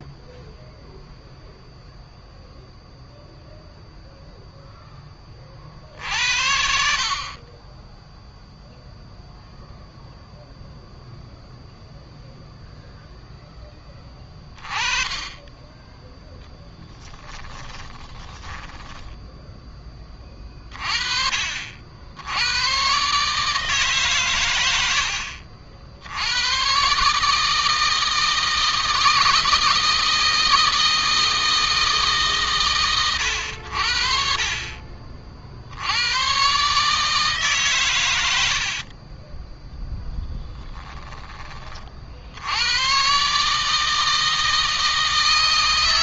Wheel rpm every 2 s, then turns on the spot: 0, 0, 10, 70, 0, 0, 0, 20, 20, 10, 40, 130, 90, 130, 160, 160, 120, 40, 140, 50, 10, 120, 160.
16-20 38-40